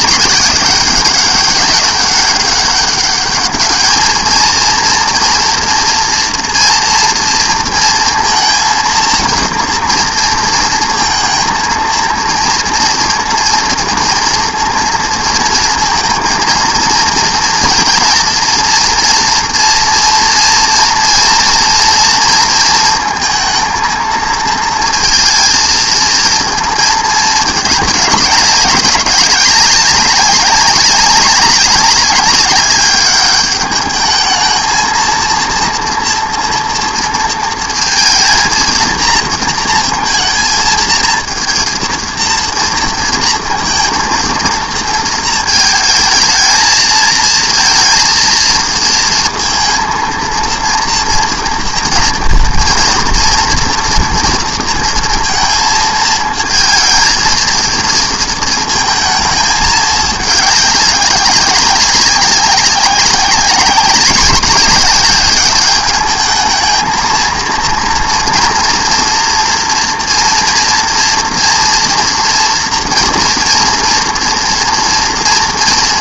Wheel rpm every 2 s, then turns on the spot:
200, 200, 230, 230, 230, 230, 230, 230, 230, 230, 230, 220, 230, 220, 200, 200, 200, 230, 230, 230, 230, 230, 230, 220, 230, 230, 230, 230, 220, 220, 200, 200, 200, 220, 230, 240, 240, 230.
none